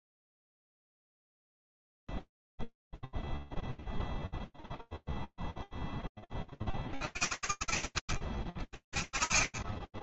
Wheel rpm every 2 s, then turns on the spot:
0, 0, 0, 10, 40.
none